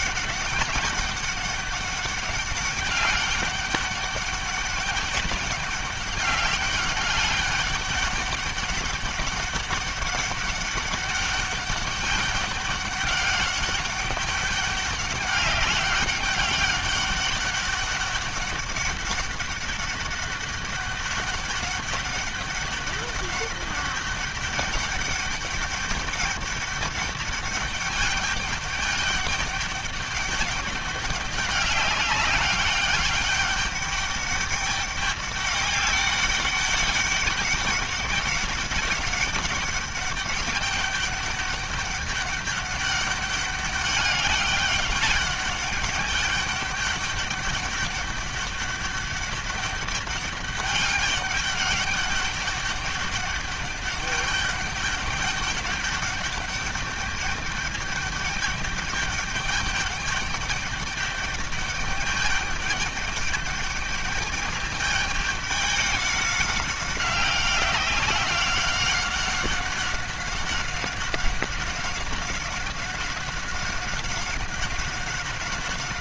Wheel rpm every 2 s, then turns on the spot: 200, 200, 200, 200, 200, 200, 200, 200, 200, 200, 200, 200, 200, 200, 210, 200, 200, 200, 200, 200, 200, 200, 200, 200, 200, 200, 200, 200, 200, 210, 200, 210, 210, 200, 190, 190, 190, 190.
none